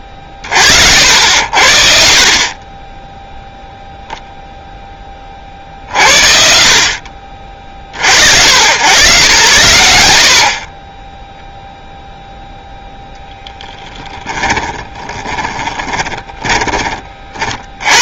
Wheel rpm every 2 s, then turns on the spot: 40, 30, 0, 60, 80, 50, 0, 10, 20.
14-18